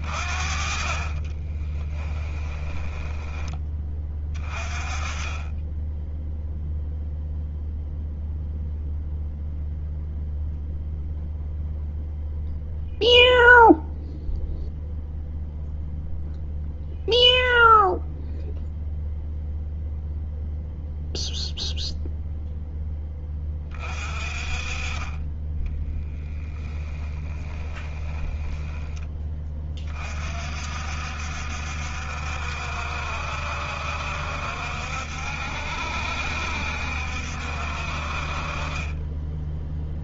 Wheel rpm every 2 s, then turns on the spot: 50, 10, 20, 0, 0, 0, 0, 0, 0, 0, 0, 0, 30, 10, 10, 50, 60, 60, 60, 40.
0-4 26-28